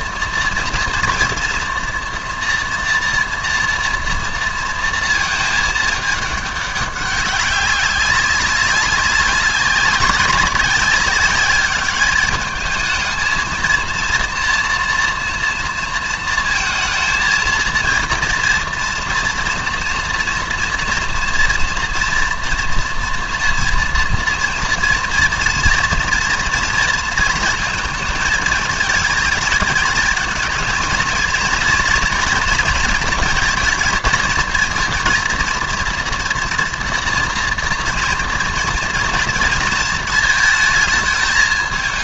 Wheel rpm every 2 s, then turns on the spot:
230, 240, 230, 200, 190, 190, 210, 230, 230, 230, 230, 230, 230, 230, 220, 230, 230, 230, 240, 230, 220.
none